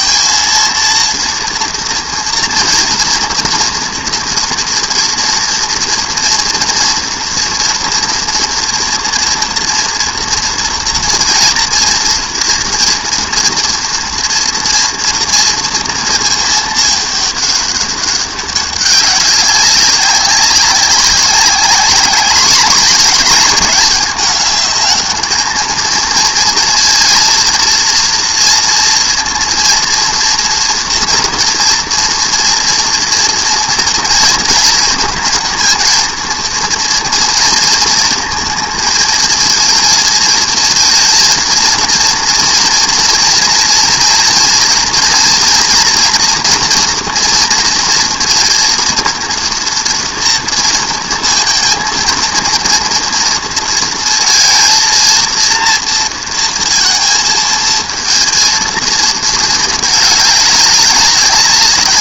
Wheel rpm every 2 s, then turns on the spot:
230, 230, 230, 230, 240, 230, 230, 230, 220, 190, 190, 210, 210, 230, 230, 230, 240, 230, 230, 230, 230, 230, 230, 240, 230, 230, 230, 220, 230, 220, 200.
none